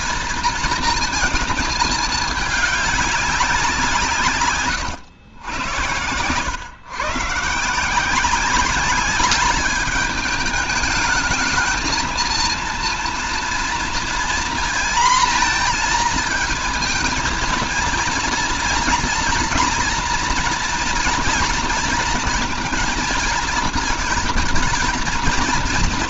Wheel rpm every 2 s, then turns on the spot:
230, 210, 140, 120, 190, 210, 230, 230, 230, 230, 230, 230, 220.
none